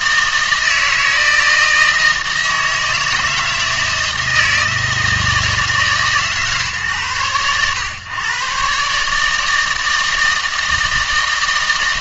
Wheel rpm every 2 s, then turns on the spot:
160, 160, 160, 130, 140, 160.
none